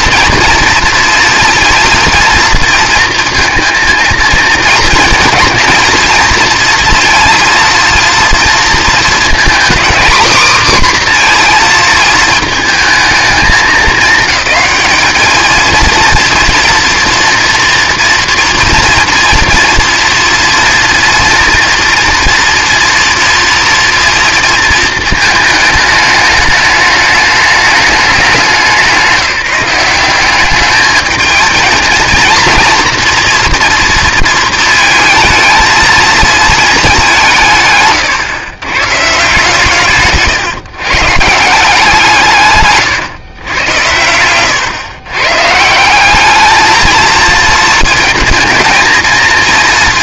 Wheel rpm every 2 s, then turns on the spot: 230, 230, 230, 230, 230, 250, 220, 200, 230, 230, 230, 230, 230, 210, 180, 210, 230, 230, 220, 130, 140, 150, 120, 220, 220.
none